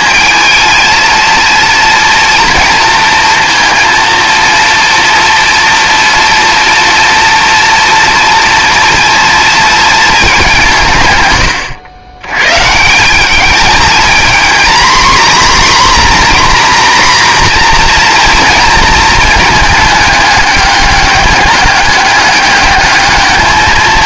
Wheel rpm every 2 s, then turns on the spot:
220, 230, 230, 230, 230, 170, 150, 250, 250, 230, 210, 210.
none